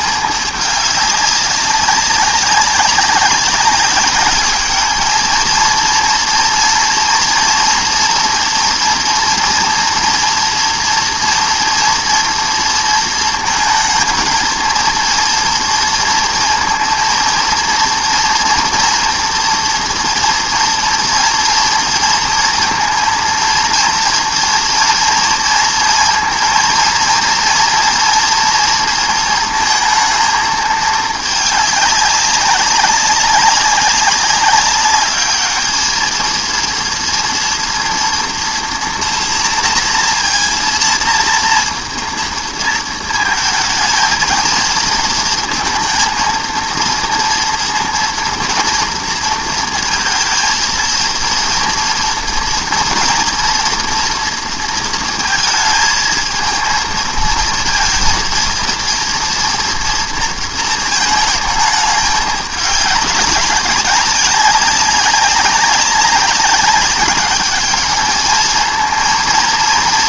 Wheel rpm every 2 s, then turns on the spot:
210, 190, 210, 230, 240, 230, 230, 220, 230, 230, 230, 230, 230, 230, 230, 220, 200, 200, 220, 230, 230, 230, 230, 230, 230, 230, 230, 230, 220, 230, 230, 200, 190, 200, 220.
none